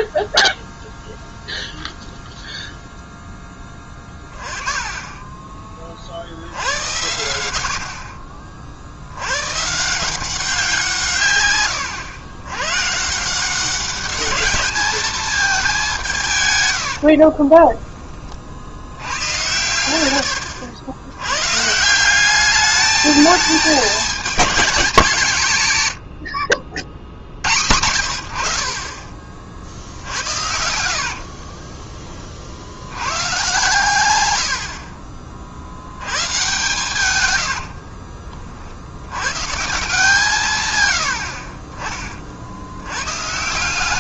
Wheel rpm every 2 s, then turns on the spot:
0, 0, 20, 90, 70, 170, 140, 210, 80, 70, 80, 210, 210, 60, 40, 70, 90, 50, 120, 60, 100, 110.
16-18 30-32